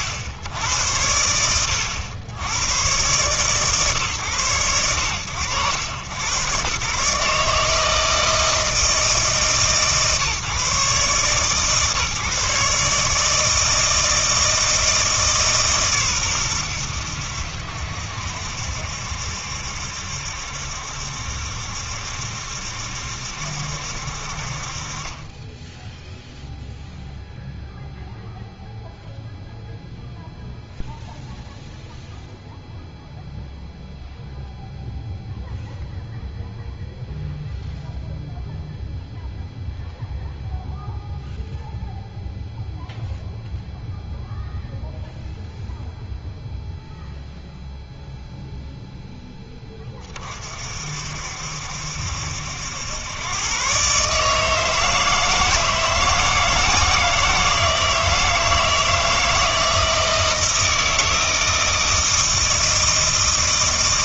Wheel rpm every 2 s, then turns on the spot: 60, 120, 100, 120, 160, 140, 140, 160, 100, 60, 70, 70, 50, 0, 0, 0, 0, 0, 0, 0, 0, 0, 0, 0, 0, 50, 80, 160, 160, 160, 160, 160.
none